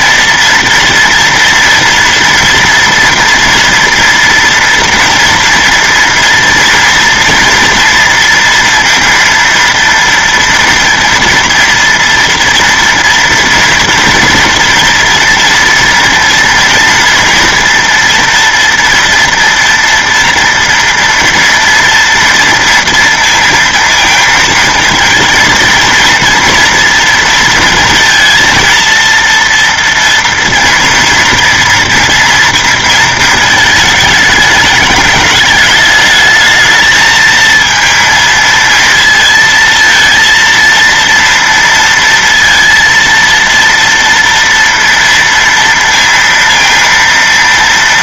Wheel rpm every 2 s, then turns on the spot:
230, 230, 230, 230, 230, 240, 230, 230, 230, 230, 230, 230, 230, 230, 230, 230, 230, 210, 220, 230, 230, 230, 230, 230.
none